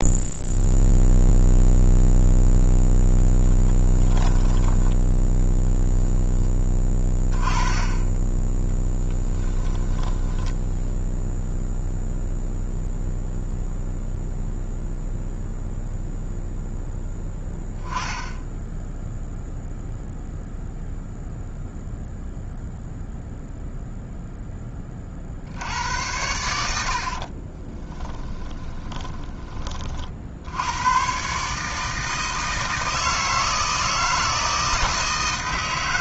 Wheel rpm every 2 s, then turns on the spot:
0, 0, 10, 20, 10, 10, 0, 0, 0, 10, 0, 0, 30, 70, 10, 100, 160, 160.
8-12 28-30